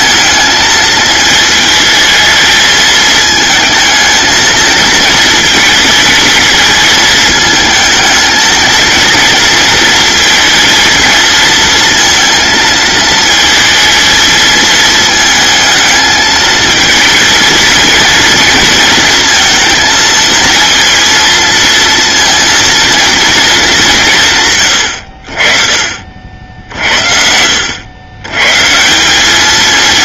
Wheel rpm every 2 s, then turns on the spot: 220, 220, 220, 220, 230, 230, 220, 220, 220, 230, 230, 230, 100, 60, 140.
none